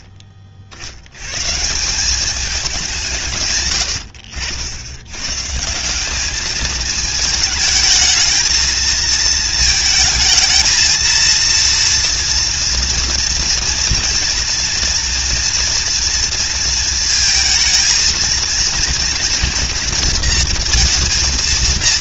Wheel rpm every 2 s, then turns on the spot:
60, 170, 80, 220, 230, 230, 230, 230, 230, 230, 230.
none